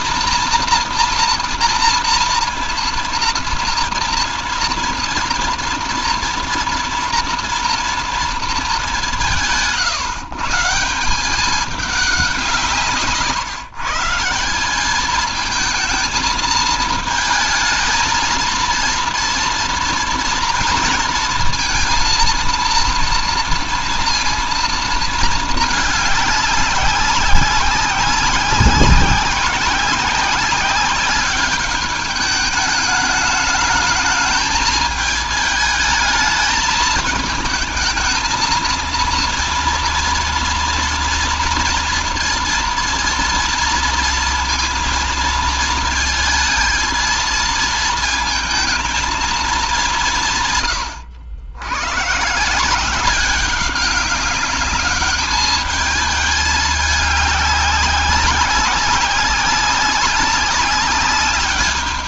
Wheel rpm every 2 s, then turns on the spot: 240, 230, 240, 230, 210, 170, 180, 190, 220, 230, 230, 230, 230, 200, 190, 190, 210, 220, 220, 230, 230, 230, 230, 220, 230, 120, 170, 200, 210, 200, 200.
none